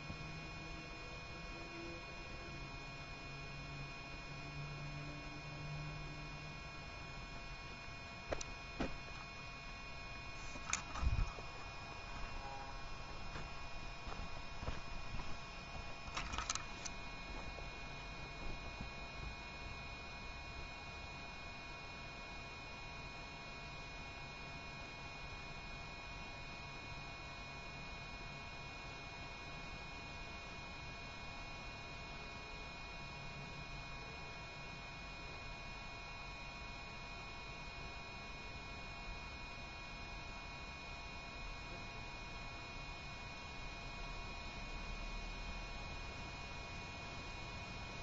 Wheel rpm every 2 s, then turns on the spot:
0, 0, 0, 0, 0, 0, 0, 0, 0, 0, 0, 0, 0, 0, 0, 0, 0, 0, 0, 0, 0, 0, 0, 0.
none